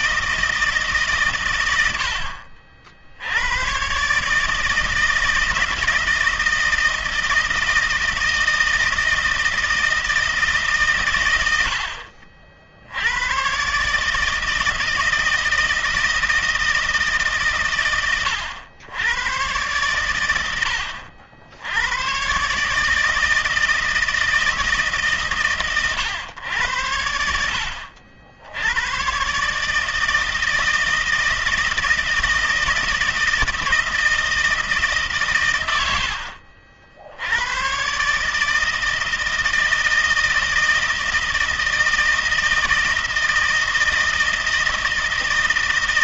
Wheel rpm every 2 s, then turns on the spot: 160, 60, 150, 160, 160, 150, 60, 160, 160, 110, 100, 140, 160, 100, 90, 160, 160, 160, 70, 150, 160, 160, 160.
none